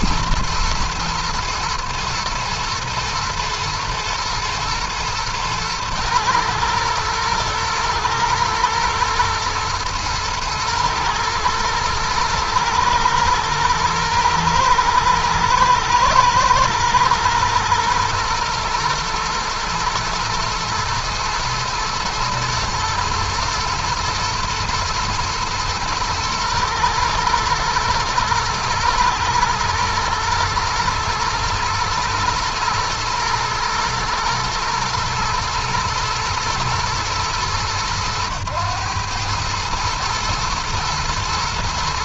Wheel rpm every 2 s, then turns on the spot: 110, 110, 110, 110, 120, 110, 110, 110, 110, 110, 110, 120, 110, 120, 110, 120, 110, 120, 110, 110, 110.
none